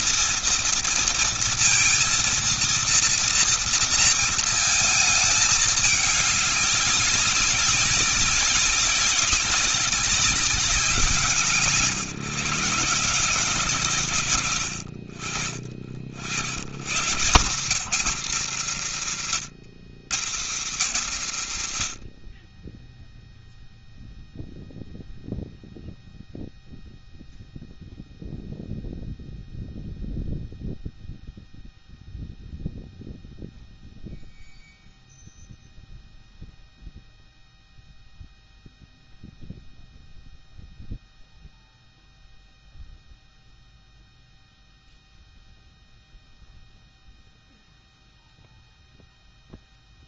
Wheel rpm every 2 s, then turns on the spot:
230, 230, 230, 200, 200, 190, 160, 100, 80, 200, 160, 50, 0, 0, 0, 0, 0, 0, 0, 0, 0, 0, 0, 0, 0.
none